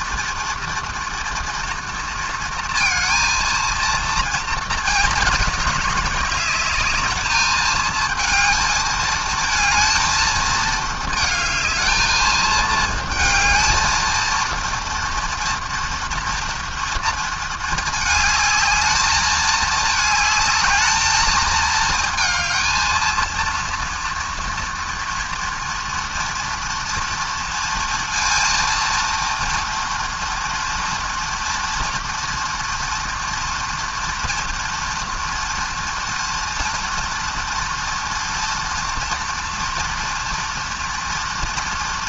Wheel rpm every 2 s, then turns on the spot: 240, 230, 230, 210, 220, 220, 220, 230, 230, 220, 220, 220, 230, 230, 230, 230, 230, 230, 230, 230, 230.
none